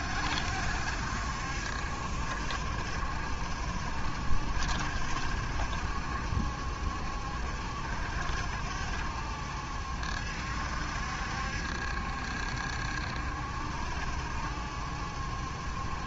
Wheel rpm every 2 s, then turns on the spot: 70, 70, 70, 70, 70, 70, 70, 70.
none